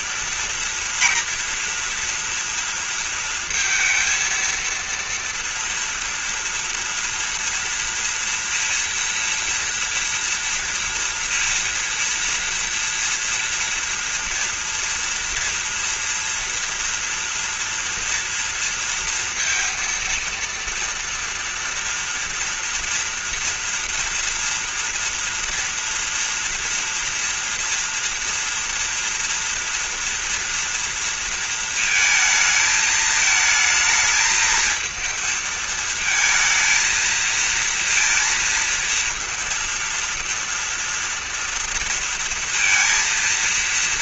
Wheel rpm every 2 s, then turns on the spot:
230, 230, 230, 230, 230, 230, 230, 240, 230, 230, 230, 230, 230, 230, 230, 230, 220, 220, 230, 230, 230, 230.
none